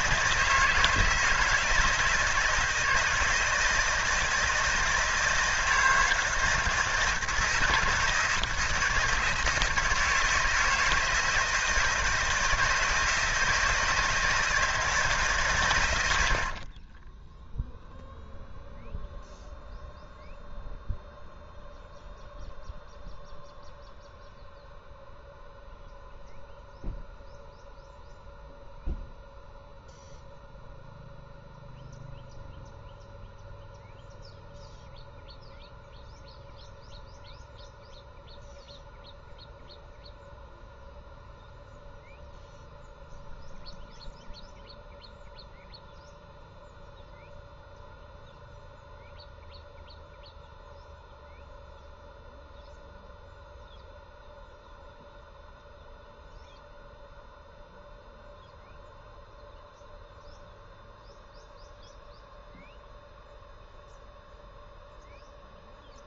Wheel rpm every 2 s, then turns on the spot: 160, 160, 160, 160, 160, 160, 170, 160, 40, 0, 0, 0, 0, 0, 0, 0, 0, 0, 0, 0, 0, 0, 0, 0, 0, 0, 0, 0, 0, 0, 0, 0, 0.
16-18